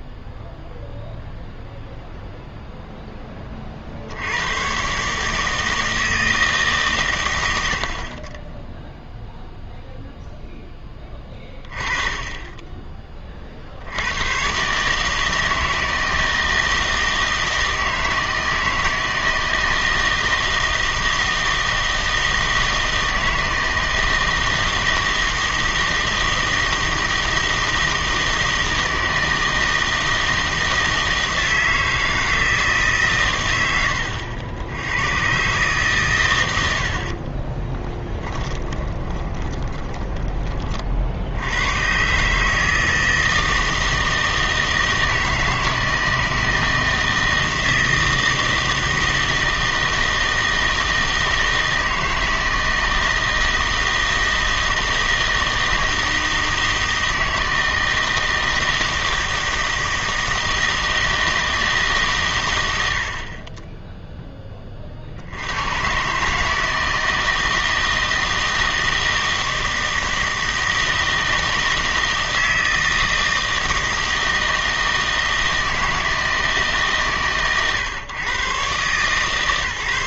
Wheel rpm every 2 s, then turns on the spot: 0, 0, 110, 150, 10, 10, 20, 130, 160, 160, 160, 160, 160, 160, 160, 160, 150, 80, 80, 30, 40, 160, 160, 160, 160, 160, 160, 160, 160, 160, 160, 90, 30, 160, 160, 160, 160, 160, 150, 130.
38-40